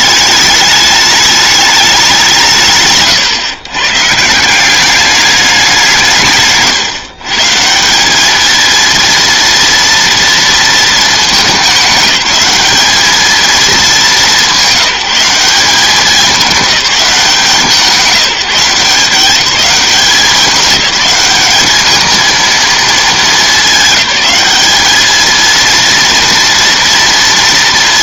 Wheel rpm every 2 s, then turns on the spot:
210, 150, 180, 140, 230, 230, 210, 190, 210, 170, 200, 220, 200, 230.
none